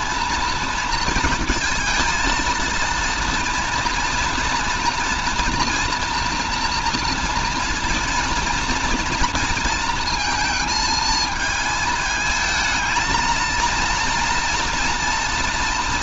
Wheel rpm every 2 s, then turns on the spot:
230, 230, 240, 230, 230, 220, 220, 230.
none